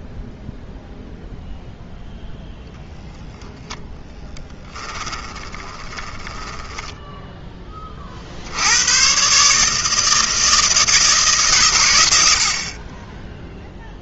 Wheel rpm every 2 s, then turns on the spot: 10, 20, 10, 60, 160, 90, 0.
0-6